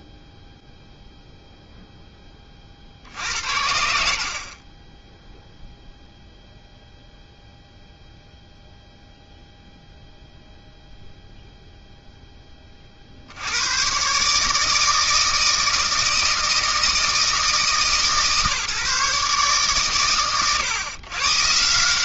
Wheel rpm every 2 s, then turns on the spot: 40, 0, 0, 0, 0, 0, 110, 160, 150, 120, 150.
none